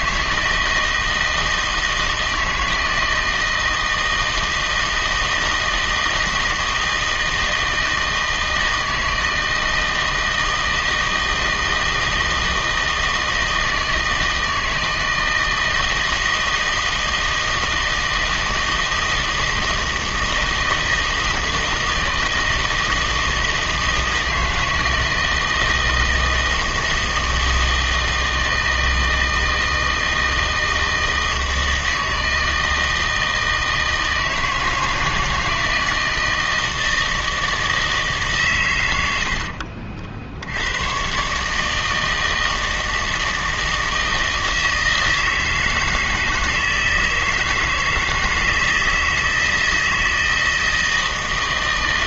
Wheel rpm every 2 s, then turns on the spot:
160, 160, 160, 160, 160, 160, 160, 160, 160, 160, 160, 160, 160, 160, 160, 160, 160, 160, 160, 110, 100, 160, 160, 160, 160, 160.
none